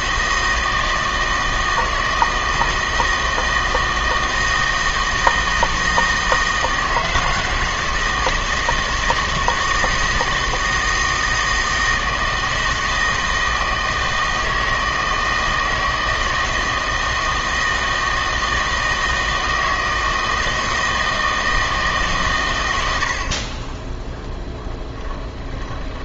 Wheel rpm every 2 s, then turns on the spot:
160, 160, 160, 160, 160, 160, 160, 160, 160, 160, 160, 100, 10.
none